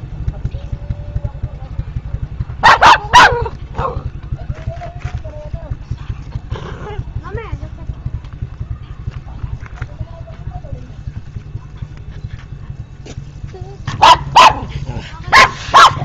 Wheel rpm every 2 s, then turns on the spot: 0, 0, 0, 0, 0, 0, 0, 0.
none